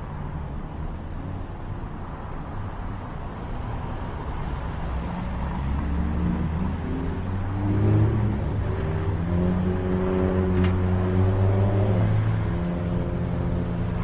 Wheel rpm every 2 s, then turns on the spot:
0, 0, 0, 0, 0, 0, 0.
none